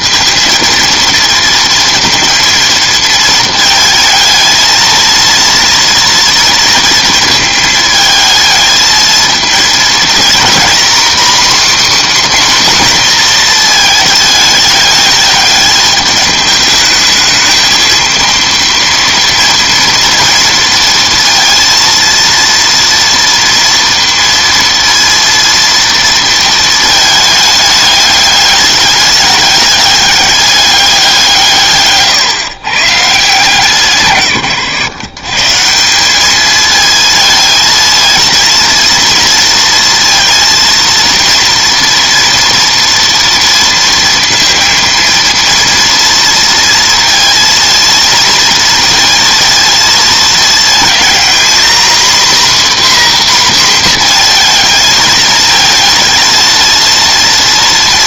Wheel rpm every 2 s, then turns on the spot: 230, 230, 230, 230, 220, 240, 270, 210, 210, 230, 230, 230, 230, 220, 210, 200, 130, 120, 220, 230, 230, 230, 230, 230, 230, 230, 270, 230, 220.
none